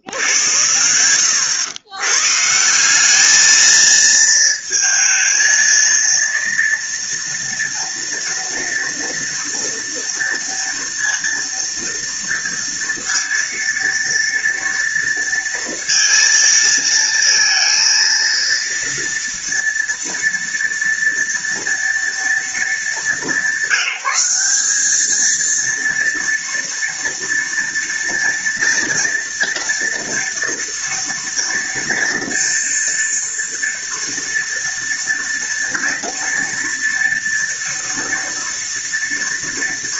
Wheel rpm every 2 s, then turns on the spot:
90, 210, 230, 230, 230, 230, 230, 230, 230, 230, 230, 190, 220, 230, 230, 230, 230, 230, 230, 230.
none